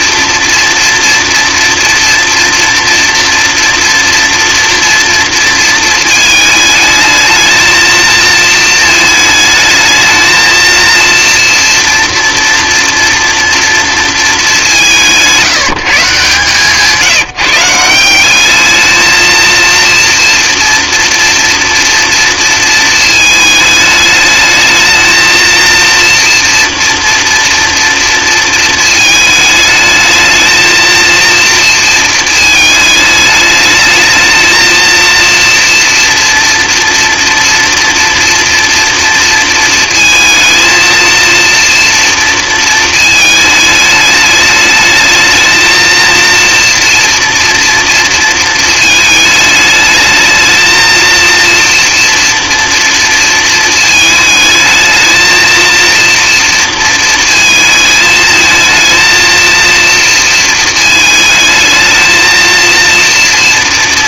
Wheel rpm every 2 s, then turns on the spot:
230, 240, 230, 220, 220, 230, 230, 200, 150, 220, 230, 220, 220, 230, 220, 230, 220, 220, 230, 240, 220, 230, 210, 230, 220, 220, 230, 220, 230, 220, 220, 230.
none